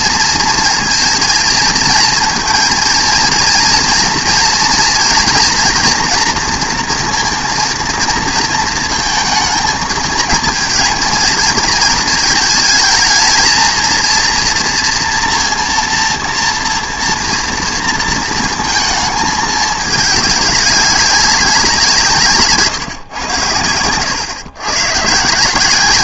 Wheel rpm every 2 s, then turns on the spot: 230, 230, 230, 230, 230, 220, 220, 230, 230, 220, 200, 150, 120.
none